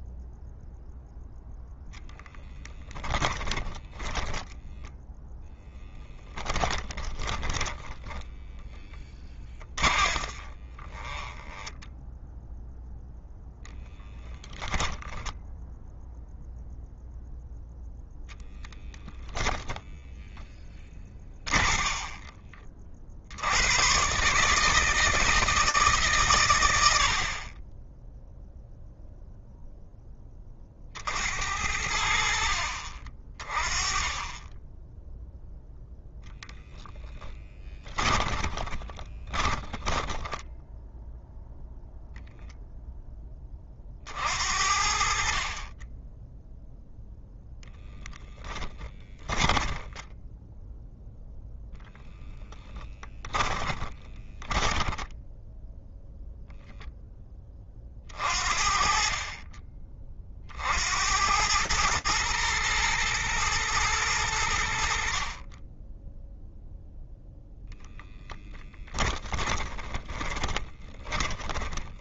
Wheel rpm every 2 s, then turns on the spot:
0, 20, 10, 10, 30, 10, 10, 10, 0, 10, 30, 100, 160, 30, 0, 70, 40, 0, 20, 20, 0, 10, 40, 0, 20, 0, 10, 0, 10, 50, 90, 110, 60, 0, 20, 10.
2-16 20-22 36-40 48-50 52-54 68-72